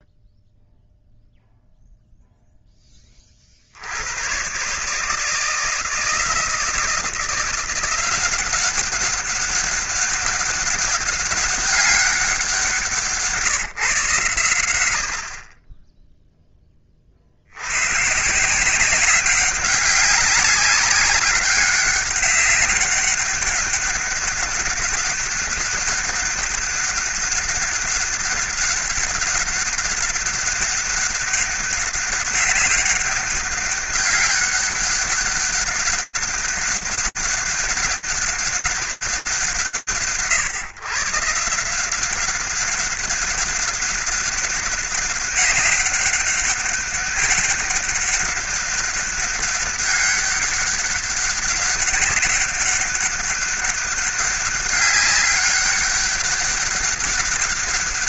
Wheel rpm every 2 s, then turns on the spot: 0, 10, 120, 160, 190, 200, 180, 100, 10, 170, 190, 200, 200, 200, 200, 200, 200, 200, 200, 200, 150, 190, 190, 200, 200, 200, 200, 200, 200.
none